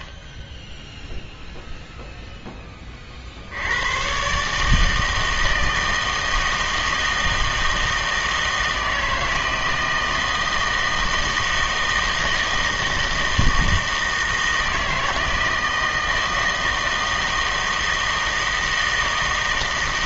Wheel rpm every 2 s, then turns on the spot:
10, 20, 150, 160, 160, 160, 160, 160, 160, 160.
none